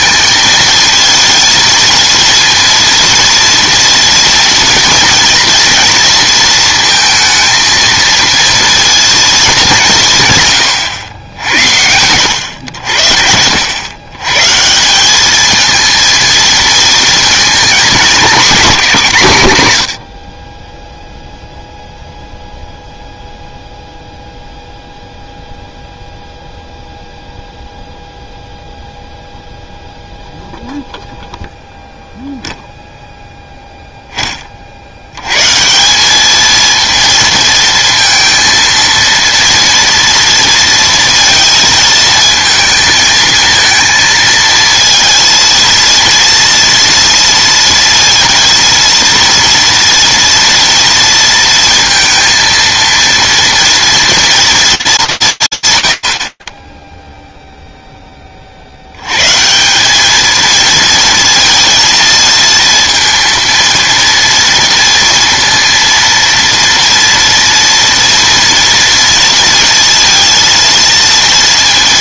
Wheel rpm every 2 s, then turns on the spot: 220, 230, 230, 230, 230, 130, 90, 170, 220, 210, 10, 0, 0, 0, 0, 0, 0, 40, 230, 230, 230, 220, 230, 230, 230, 230, 230, 230, 40, 40, 230, 230, 230, 240, 230, 230.
none